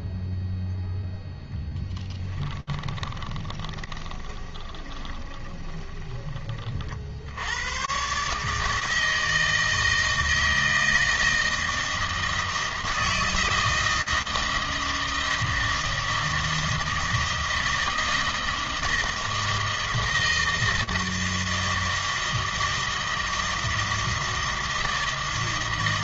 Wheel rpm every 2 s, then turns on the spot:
0, 20, 20, 50, 160, 160, 160, 160, 160, 160, 160, 160, 160.
2-6